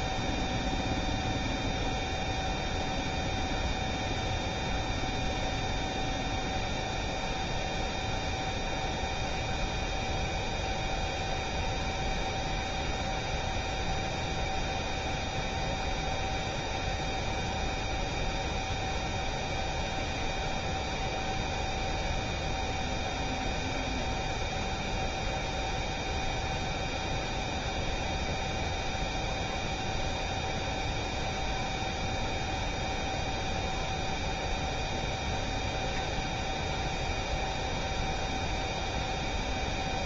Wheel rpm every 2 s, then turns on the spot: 0, 0, 0, 0, 0, 0, 0, 0, 0, 0, 0, 0, 0, 0, 0, 0, 0, 0, 0, 0.
none